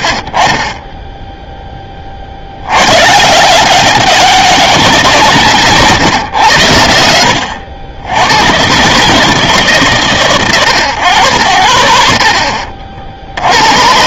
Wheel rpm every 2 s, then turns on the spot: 20, 100, 180, 100, 130, 100, 70.
none